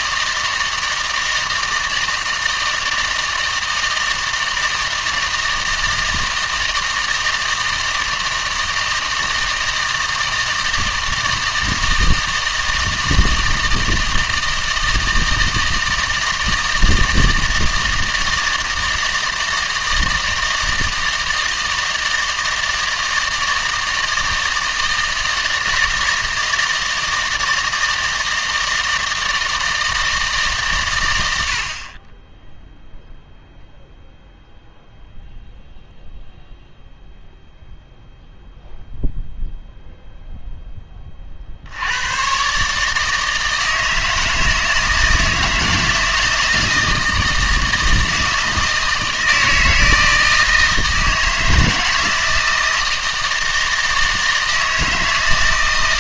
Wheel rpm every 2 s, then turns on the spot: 160, 160, 160, 160, 160, 160, 160, 160, 160, 160, 160, 160, 160, 160, 160, 130, 0, 0, 0, 0, 10, 140, 160, 160, 160, 160, 160, 160.
none